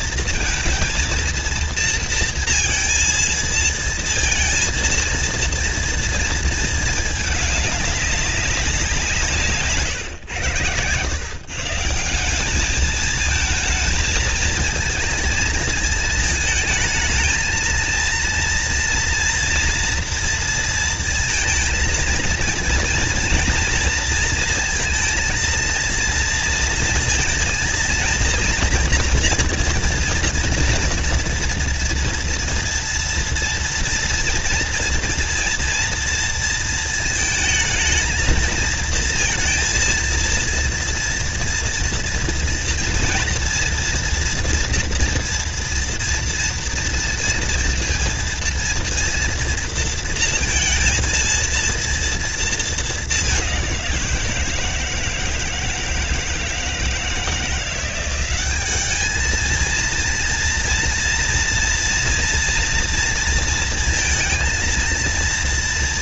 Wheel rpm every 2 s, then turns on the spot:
230, 230, 230, 220, 170, 120, 220, 220, 220, 230, 230, 230, 230, 230, 230, 240, 230, 240, 220, 220, 230, 240, 230, 230, 230, 230, 210, 160, 160, 210, 230, 230, 230.
none